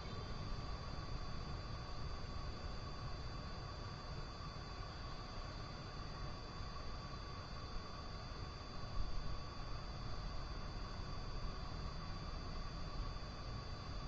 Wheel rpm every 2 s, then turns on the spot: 0, 0, 0, 0, 0, 0, 0.
none